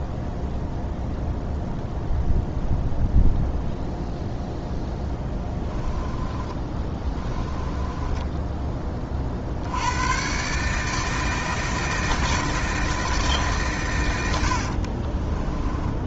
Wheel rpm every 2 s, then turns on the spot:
0, 0, 0, 20, 20, 150, 160, 50.
6-8 14-16